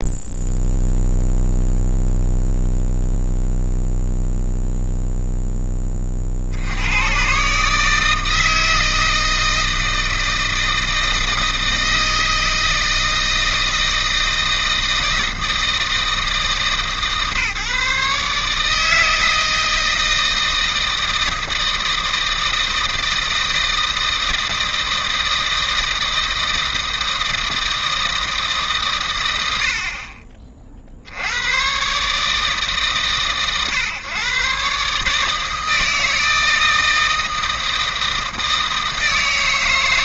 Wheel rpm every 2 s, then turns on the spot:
0, 0, 0, 90, 160, 160, 160, 160, 150, 160, 160, 160, 160, 160, 130, 50, 140, 140, 160, 160.
none